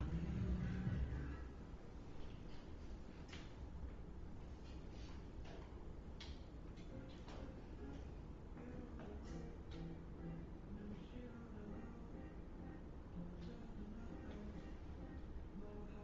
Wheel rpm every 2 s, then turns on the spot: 0, 0, 0, 0, 0, 0, 0, 0.
none